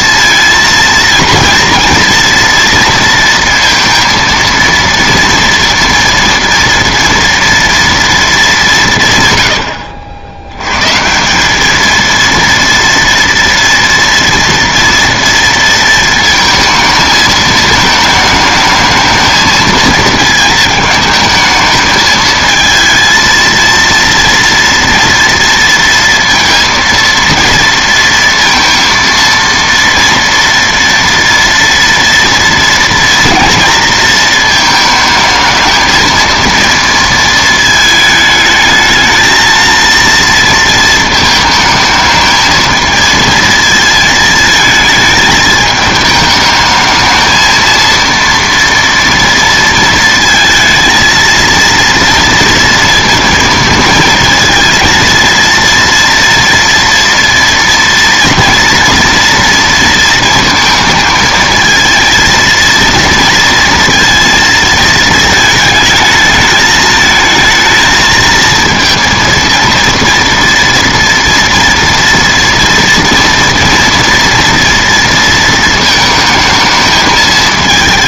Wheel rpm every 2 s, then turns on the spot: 230, 230, 230, 230, 190, 110, 230, 230, 230, 220, 220, 220, 230, 230, 230, 230, 230, 220, 230, 220, 230, 220, 220, 220, 230, 230, 230, 230, 230, 230, 220, 230, 230, 220, 230, 230, 230, 230, 220.
none